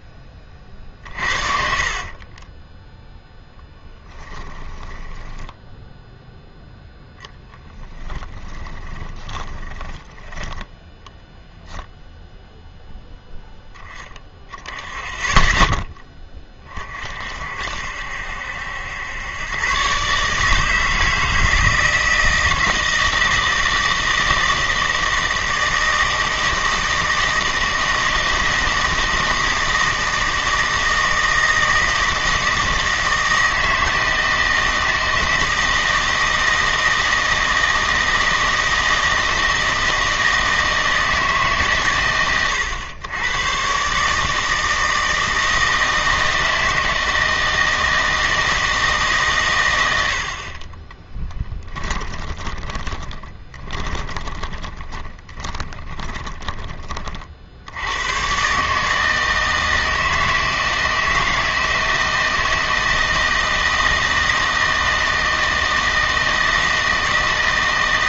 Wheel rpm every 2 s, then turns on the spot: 20, 10, 10, 0, 10, 10, 0, 10, 30, 80, 150, 160, 160, 160, 160, 160, 160, 160, 160, 160, 160, 110, 160, 160, 160, 30, 20, 30, 20, 140, 160, 160, 160, 160.
2-6 8-12 52-56